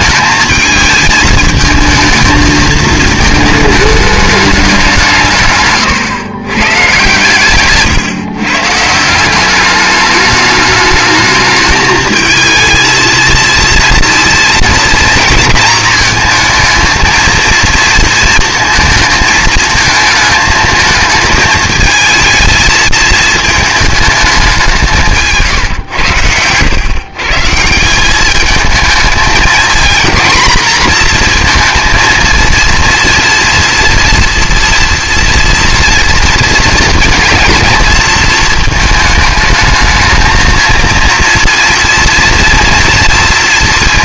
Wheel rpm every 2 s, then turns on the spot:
220, 220, 190, 130, 150, 210, 230, 230, 220, 220, 220, 220, 180, 120, 220, 240, 240, 230, 230, 220, 220, 240.
none